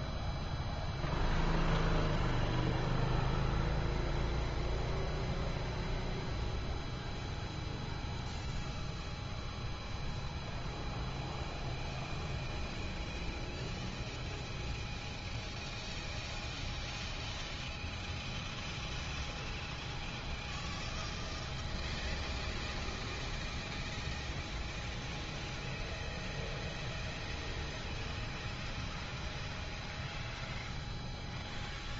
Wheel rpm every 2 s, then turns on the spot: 0, 0, 0, 0, 0, 0, 0, 0, 0, 0, 0, 0, 0, 0, 0, 0.
none